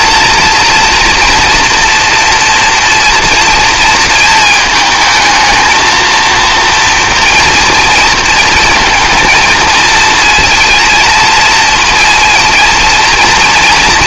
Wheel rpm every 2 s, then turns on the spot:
230, 230, 220, 230, 220, 230, 230.
none